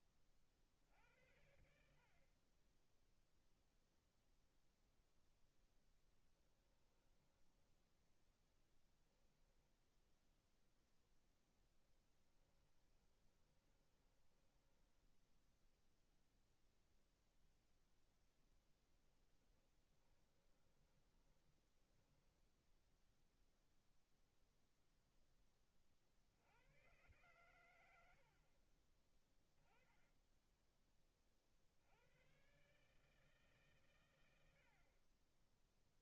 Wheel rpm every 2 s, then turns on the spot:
60, 0, 0, 10, 10, 0, 20, 10, 0, 10, 20, 0, 10, 120, 30, 30, 150, 30.
6-10 12-16 18-22